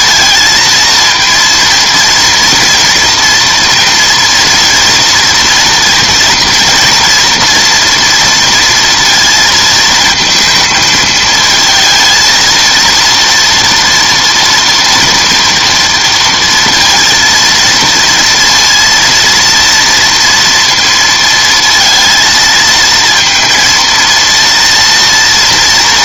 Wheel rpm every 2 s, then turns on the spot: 230, 230, 240, 230, 230, 230, 230, 230, 230, 230, 230, 230, 230.
none